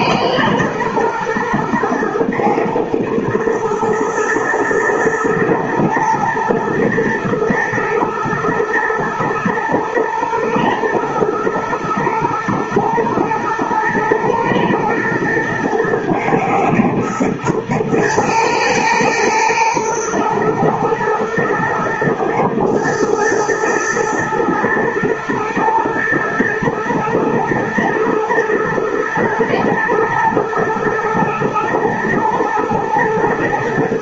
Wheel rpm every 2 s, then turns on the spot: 110, 110, 120, 120, 120, 110, 110, 120, 110, 110, 110, 120, 120, 110, 110, 120, 120.
none